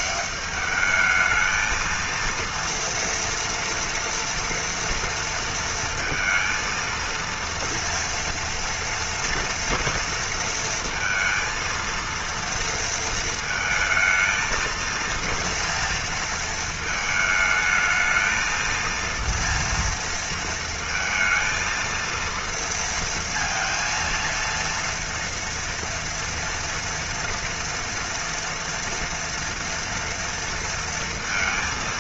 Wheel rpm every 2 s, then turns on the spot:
210, 230, 240, 230, 230, 230, 230, 220, 220, 230, 220, 230, 230, 230, 230, 230.
none